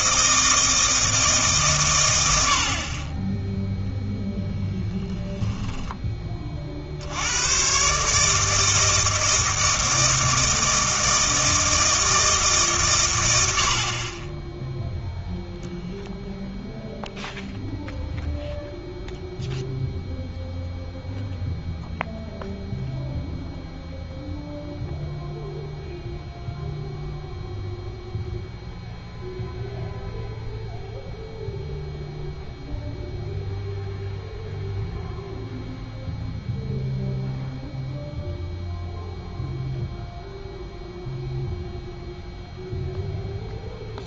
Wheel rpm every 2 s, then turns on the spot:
160, 50, 10, 50, 160, 160, 140, 0, 0, 0, 0, 0, 0, 0, 0, 0, 0, 0, 0, 0, 0, 0.
4-6